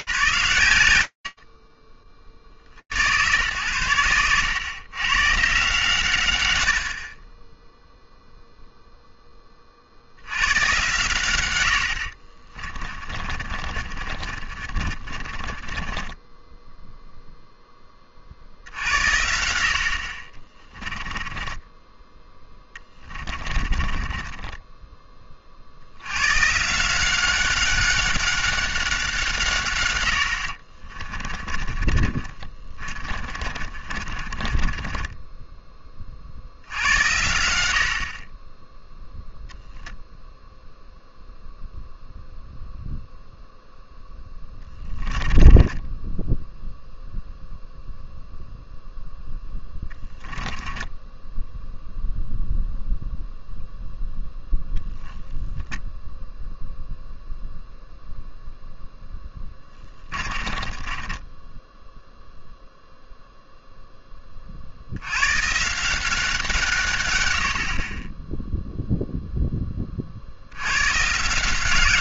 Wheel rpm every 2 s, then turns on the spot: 50, 110, 90, 0, 110, 50, 40, 10, 70, 20, 10, 10, 140, 190, 40, 30, 20, 70, 10, 0, 0, 10, 10, 0, 10, 0, 0, 0, 0, 20, 0, 20, 170, 30, 30, 180.
10-14 18-24 28-34 42-46 48-50 58-60